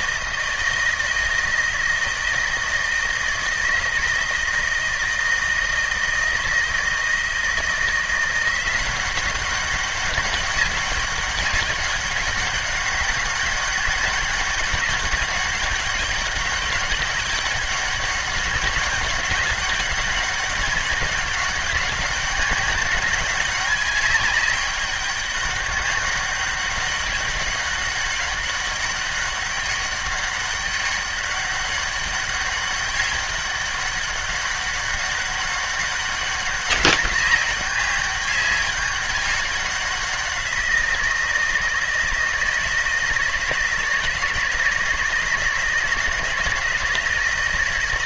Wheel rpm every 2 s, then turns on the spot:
160, 160, 160, 160, 180, 200, 190, 200, 200, 200, 200, 200, 200, 200, 200, 200, 200, 190, 200, 200, 170, 160, 170, 160.
none